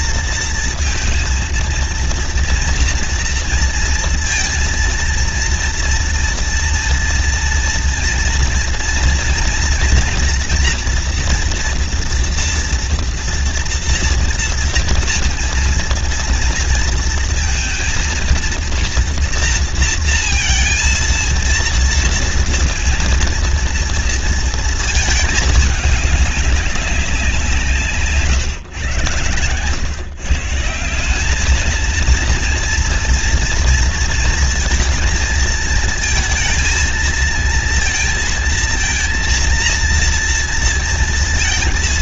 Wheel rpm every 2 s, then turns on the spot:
230, 230, 230, 230, 230, 230, 230, 230, 230, 230, 230, 230, 220, 200, 130, 170, 230, 230, 230, 230, 230.
none